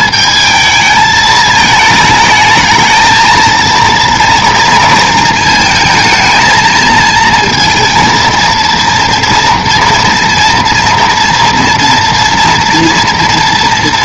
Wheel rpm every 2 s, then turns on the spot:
220, 220, 230, 220, 230, 230, 230.
none